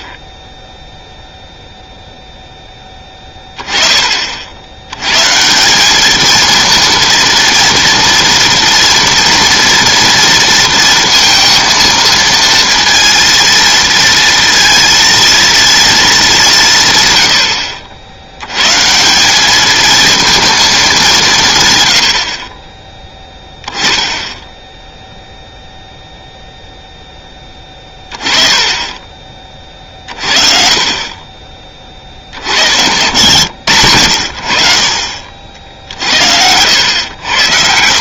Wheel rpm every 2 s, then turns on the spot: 0, 10, 80, 230, 230, 230, 230, 230, 170, 120, 220, 30, 0, 0, 20, 40, 80, 60, 90.
none